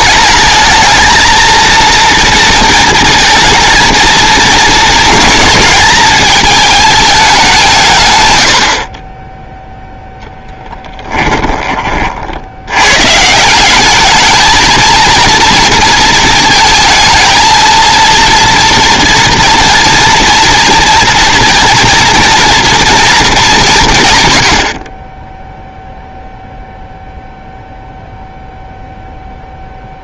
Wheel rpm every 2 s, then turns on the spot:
220, 230, 230, 210, 70, 10, 80, 220, 220, 230, 230, 240, 70, 0, 0.
10-12